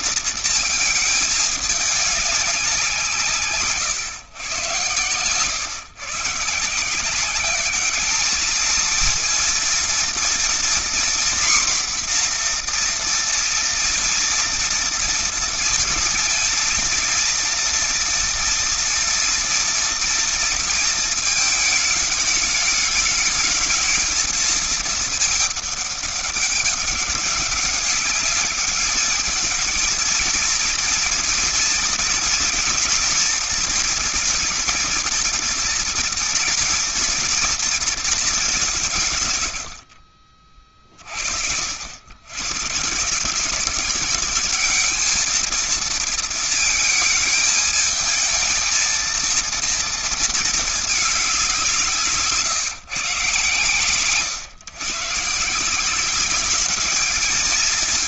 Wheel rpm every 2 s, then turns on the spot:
230, 200, 120, 140, 220, 240, 240, 230, 230, 230, 230, 210, 220, 200, 210, 230, 240, 230, 230, 200, 40, 130, 200, 230, 220, 220, 140, 120, 200.
none